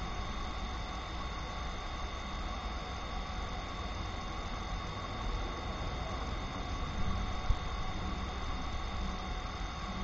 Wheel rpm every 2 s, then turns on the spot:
0, 0, 0, 0, 0.
none